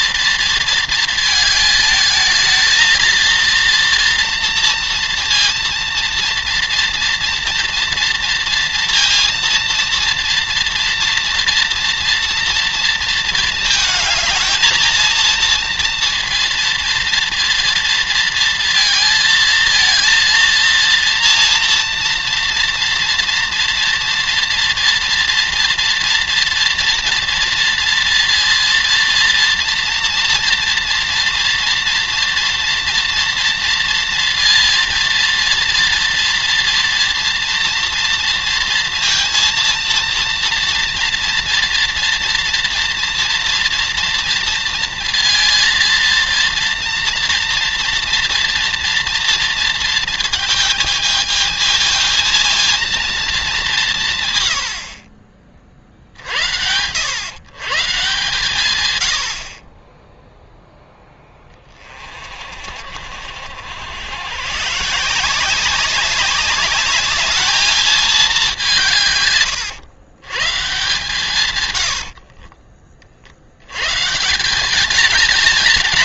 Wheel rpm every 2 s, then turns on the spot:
230, 220, 230, 230, 230, 230, 230, 230, 230, 230, 230, 230, 230, 230, 230, 240, 230, 230, 230, 230, 230, 230, 230, 230, 230, 220, 230, 110, 90, 120, 0, 50, 140, 200, 190, 130, 30, 180.
72-74